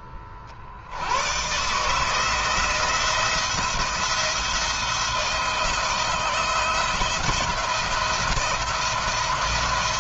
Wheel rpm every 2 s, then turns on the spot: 90, 170, 170, 170, 170.
none